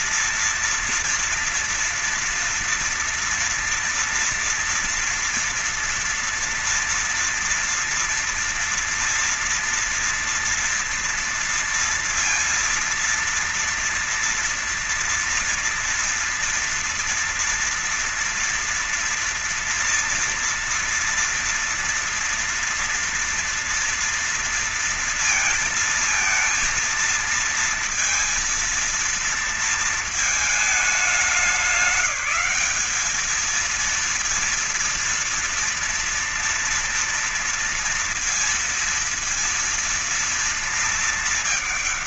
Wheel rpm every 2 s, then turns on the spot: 230, 230, 230, 230, 230, 230, 230, 230, 240, 230, 240, 230, 230, 220, 230, 220, 200, 230, 230, 230, 230.
none